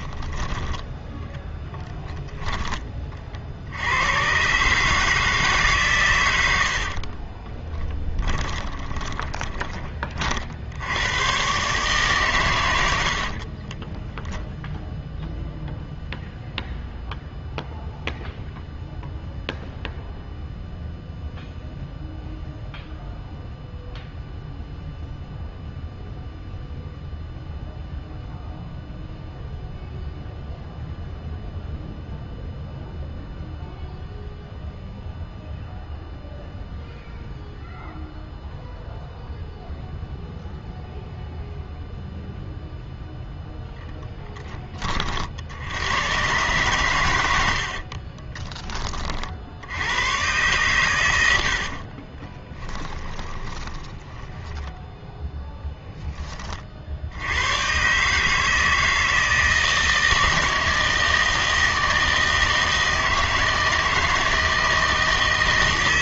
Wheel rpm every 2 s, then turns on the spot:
10, 10, 130, 80, 10, 60, 110, 0, 0, 0, 0, 0, 0, 0, 0, 0, 0, 0, 0, 0, 0, 0, 20, 130, 20, 120, 20, 20, 40, 160, 160, 160, 160.
6-10 52-56